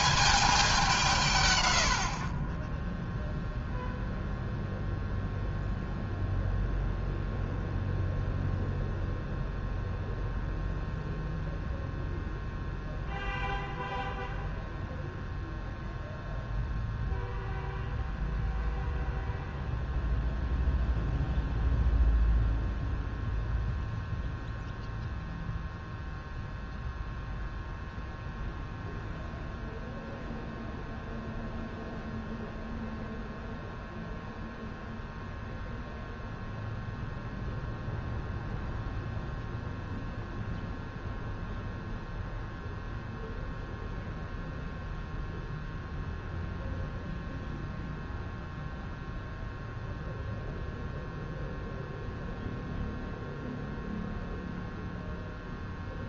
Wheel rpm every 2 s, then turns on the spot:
180, 10, 0, 0, 0, 0, 0, 0, 0, 0, 0, 0, 0, 0, 0, 0, 0, 0, 0, 0, 0, 0, 0, 0, 0, 0, 0, 0.
none